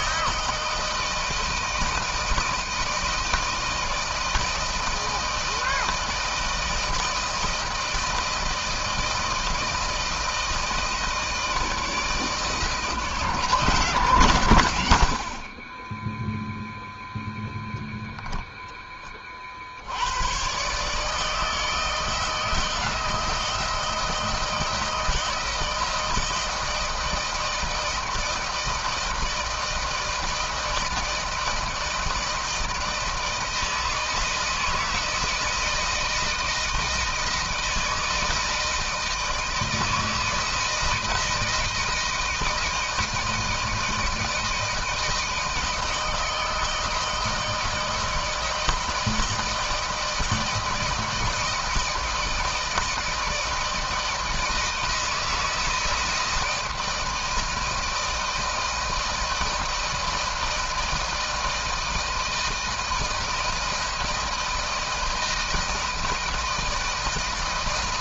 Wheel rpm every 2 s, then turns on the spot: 160, 160, 160, 160, 160, 160, 160, 120, 0, 0, 110, 160, 160, 170, 160, 160, 160, 160, 160, 160, 160, 160, 160, 160, 160, 160, 160, 160, 160, 160, 160, 160, 160, 160.
none